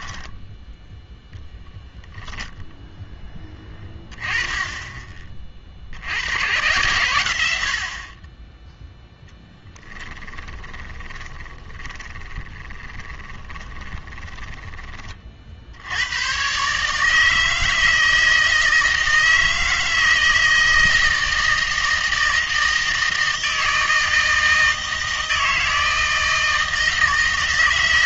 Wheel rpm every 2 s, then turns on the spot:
10, 0, 20, 120, 10, 20, 20, 20, 140, 160, 160, 160, 160, 160.
0-2 10-14